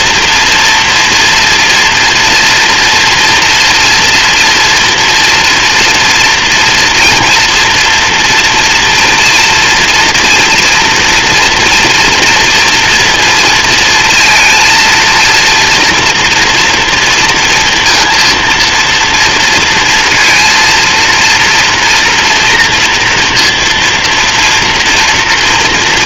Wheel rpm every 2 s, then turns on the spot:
230, 230, 230, 230, 230, 230, 240, 230, 230, 230, 230, 230, 230.
none